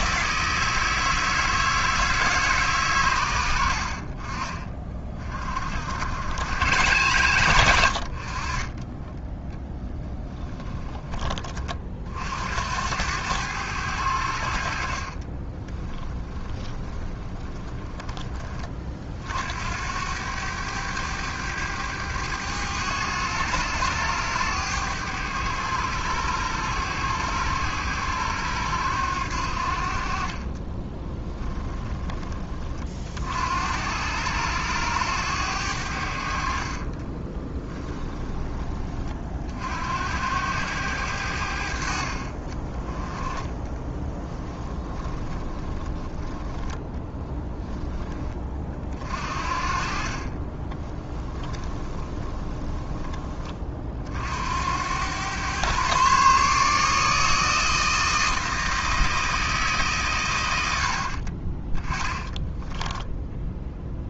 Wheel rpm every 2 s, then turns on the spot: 160, 140, 40, 110, 20, 20, 80, 50, 10, 40, 100, 100, 100, 100, 90, 20, 40, 100, 40, 30, 90, 20, 10, 10, 40, 20, 20, 90, 150, 160, 70, 10.
16-18 30-32 36-38 44-46 50-52 60-64